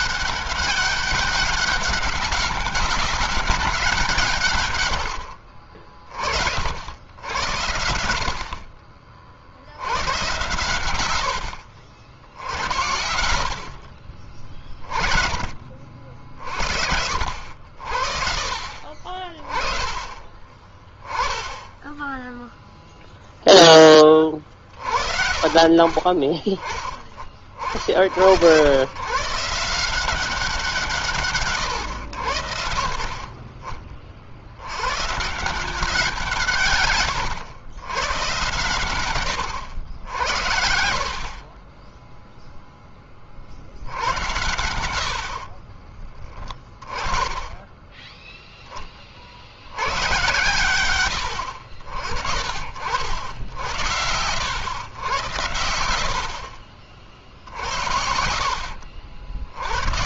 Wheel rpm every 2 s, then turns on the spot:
200, 200, 120, 80, 50, 100, 70, 30, 50, 40, 20, 0, 40, 30, 110, 160, 50, 120, 140, 110, 60, 20, 90, 20, 20, 110, 70, 110, 50, 70.
none